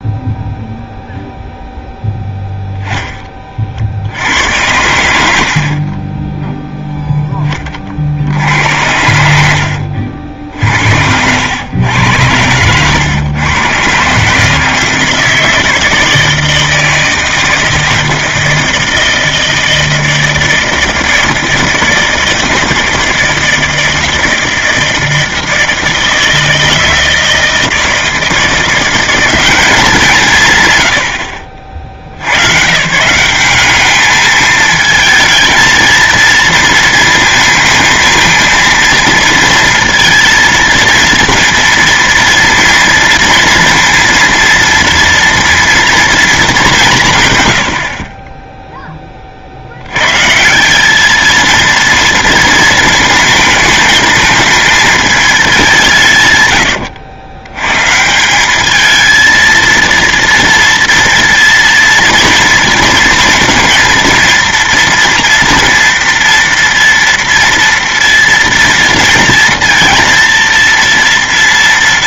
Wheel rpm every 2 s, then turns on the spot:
0, 10, 90, 10, 80, 60, 100, 160, 160, 160, 160, 160, 160, 160, 170, 140, 120, 220, 230, 220, 230, 230, 230, 200, 10, 170, 230, 220, 120, 210, 230, 230, 230, 230, 230, 230.
none